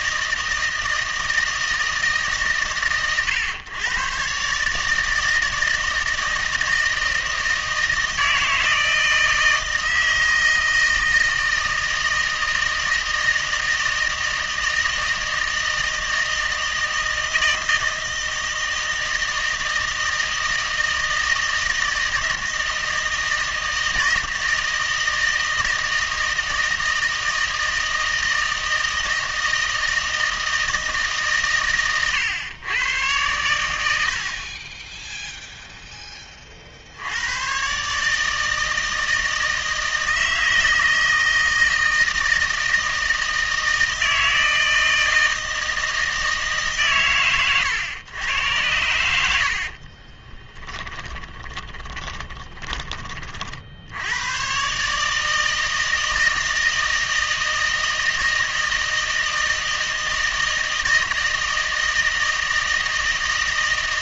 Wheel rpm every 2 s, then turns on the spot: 160, 110, 150, 160, 160, 160, 160, 160, 160, 160, 160, 160, 160, 160, 160, 160, 110, 20, 60, 160, 160, 160, 160, 130, 90, 20, 30, 140, 160, 160, 160, 160.
50-52